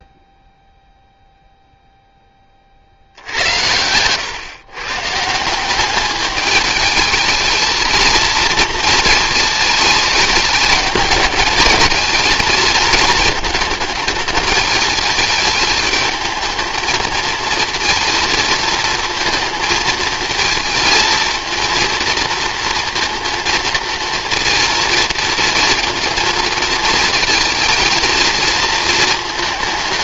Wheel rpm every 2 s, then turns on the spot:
0, 70, 140, 220, 230, 210, 220, 210, 220, 220, 230, 230, 230, 220, 220.
none